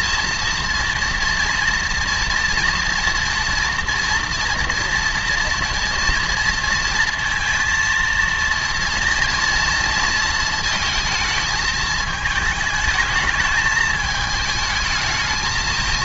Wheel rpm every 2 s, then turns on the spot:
230, 240, 240, 230, 230, 230, 220, 220.
none